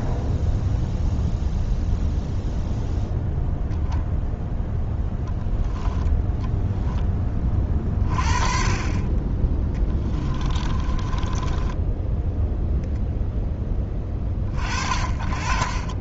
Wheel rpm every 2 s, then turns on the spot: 0, 0, 0, 10, 30, 20, 0, 40.
10-12